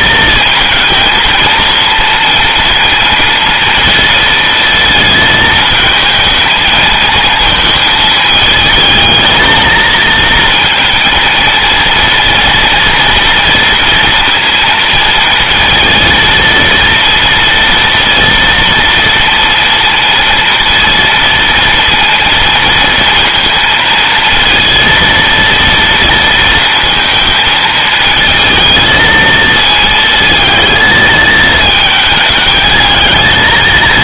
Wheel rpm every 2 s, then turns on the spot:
230, 230, 220, 220, 220, 230, 230, 230, 230, 230, 230, 230, 230, 230, 220, 220, 220.
none